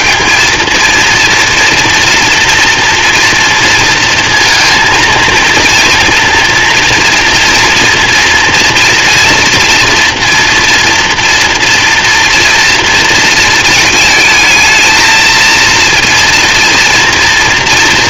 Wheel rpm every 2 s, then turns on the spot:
230, 230, 230, 230, 230, 230, 230, 220, 230.
none